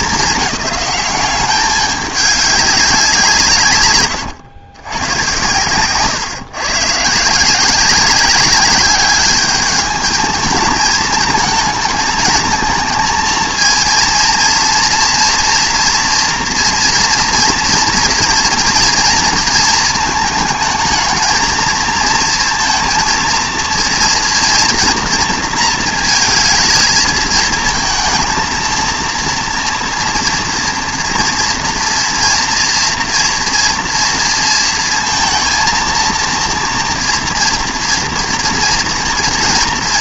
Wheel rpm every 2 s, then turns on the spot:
200, 190, 110, 130, 200, 220, 230, 230, 230, 230, 220, 230, 230, 220, 230, 230, 230, 230, 230, 230.
none